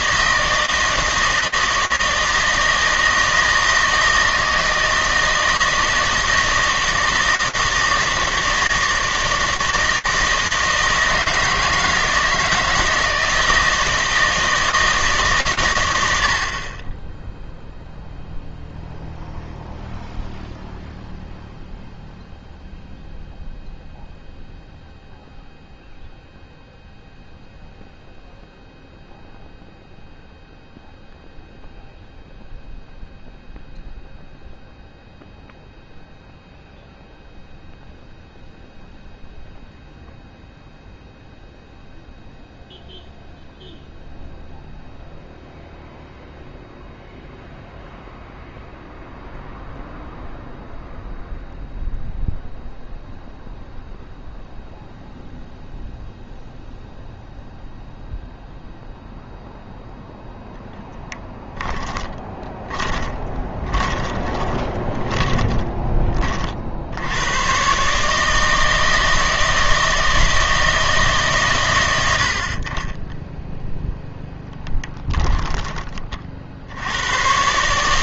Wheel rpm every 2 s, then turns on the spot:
160, 160, 160, 160, 160, 160, 160, 160, 30, 0, 0, 0, 0, 0, 0, 0, 0, 0, 0, 0, 0, 0, 0, 0, 0, 0, 0, 0, 0, 0, 10, 20, 20, 60, 160, 160, 40, 10, 80.
62-66